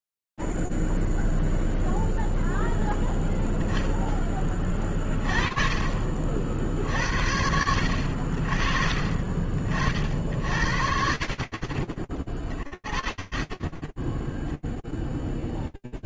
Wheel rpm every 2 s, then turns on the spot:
0, 0, 0, 30, 70, 50, 30, 0.
none